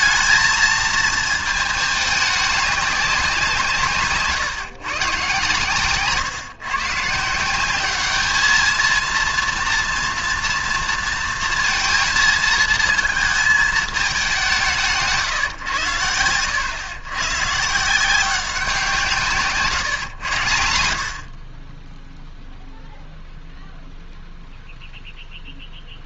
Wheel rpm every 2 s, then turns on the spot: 220, 200, 140, 130, 220, 230, 220, 180, 100, 180, 80, 0, 0.
none